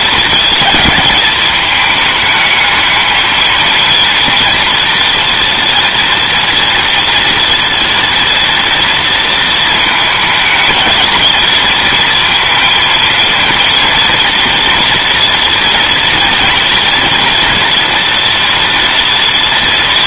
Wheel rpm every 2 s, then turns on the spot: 220, 220, 230, 230, 230, 220, 230, 230, 240, 230.
none